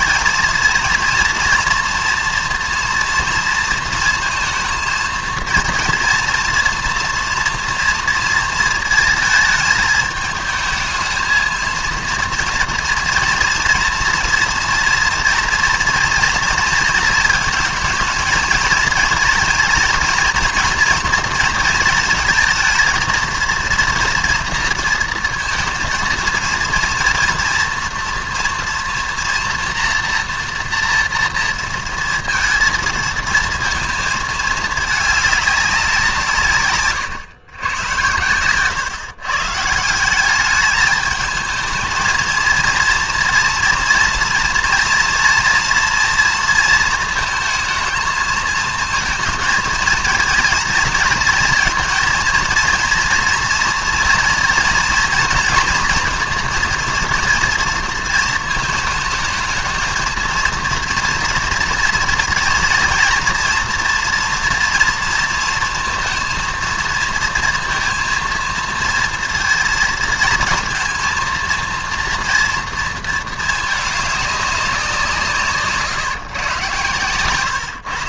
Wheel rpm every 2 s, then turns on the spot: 220, 230, 230, 230, 230, 220, 230, 230, 230, 230, 230, 220, 230, 230, 230, 230, 230, 220, 170, 110, 180, 220, 230, 240, 220, 220, 230, 230, 230, 230, 220, 230, 230, 230, 230, 220, 230, 210, 150.
none